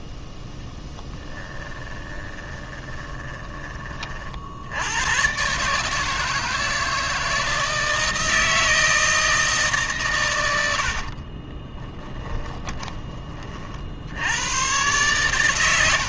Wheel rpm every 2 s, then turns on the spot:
10, 20, 70, 160, 160, 90, 20, 110.
0-4 12-14